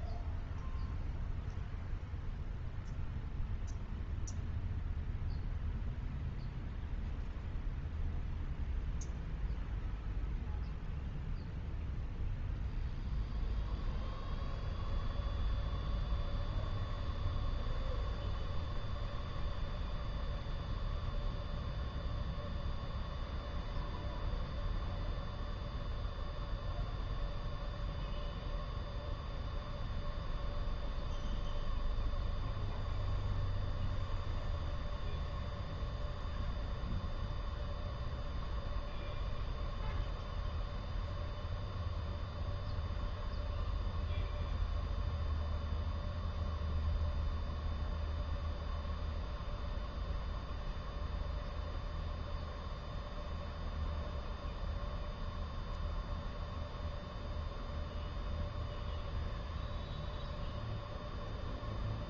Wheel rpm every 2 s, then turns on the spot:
0, 0, 0, 0, 0, 0, 0, 0, 0, 0, 0, 0, 0, 0, 0, 0, 0, 0, 0, 0, 0, 0, 0, 0, 0, 0, 0, 0, 0, 0, 0.
none